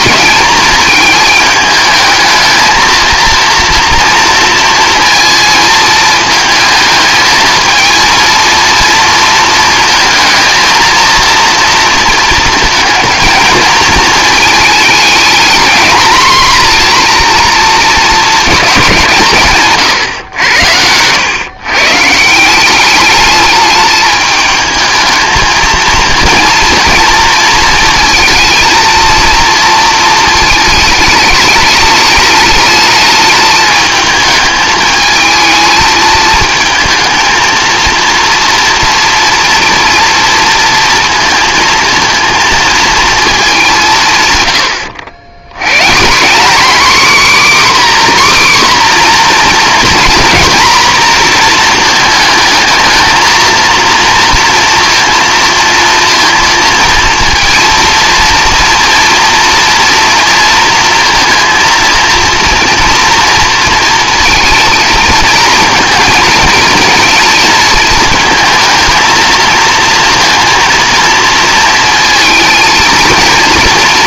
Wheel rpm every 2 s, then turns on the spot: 220, 220, 230, 220, 230, 230, 230, 210, 230, 210, 90, 190, 220, 230, 230, 220, 210, 220, 220, 230, 230, 220, 100, 240, 260, 240, 220, 230, 230, 230, 230, 230, 230, 230, 230, 230, 230.
none